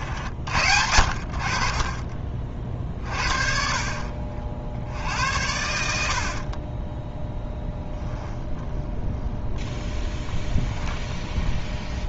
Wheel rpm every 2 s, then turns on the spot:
80, 30, 60, 20, 10, 10.
6-10